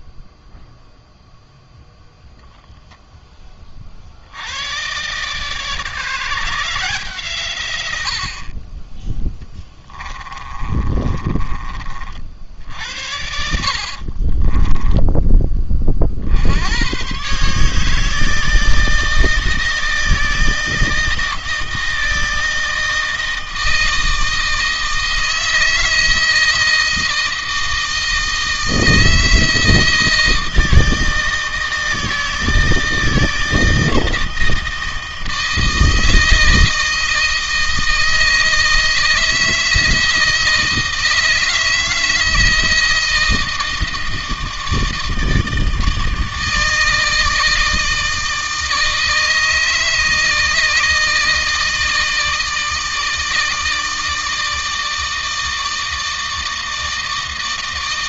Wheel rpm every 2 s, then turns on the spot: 0, 0, 110, 150, 30, 30, 70, 20, 90, 160, 160, 160, 160, 160, 160, 160, 160, 160, 160, 160, 160, 160, 160, 160, 160, 160, 160, 160, 160.
10-12 14-16